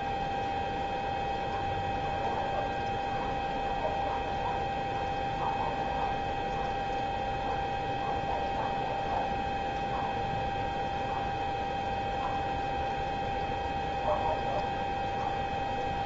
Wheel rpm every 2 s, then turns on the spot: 0, 0, 0, 0, 0, 0, 0, 0.
none